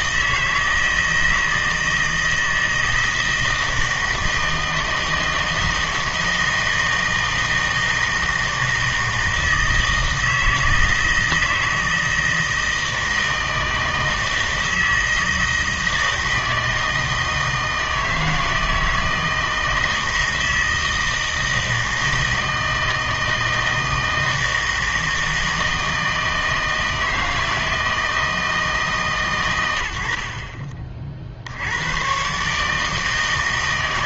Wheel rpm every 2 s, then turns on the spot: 160, 160, 160, 160, 160, 160, 160, 160, 160, 160, 160, 160, 160, 160, 160, 40, 150.
none